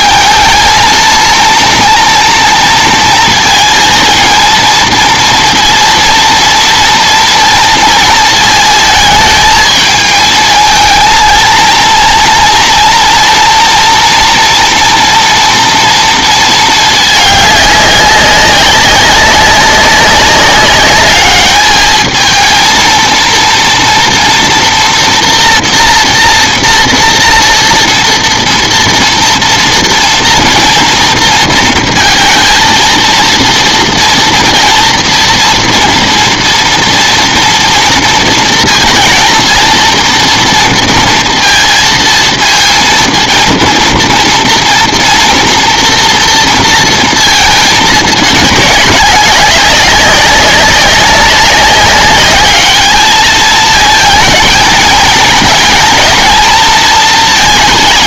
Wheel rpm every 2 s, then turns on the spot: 220, 230, 230, 230, 220, 220, 230, 230, 220, 200, 200, 230, 230, 240, 230, 230, 230, 230, 230, 230, 230, 230, 230, 230, 200, 190, 210, 220, 220.
none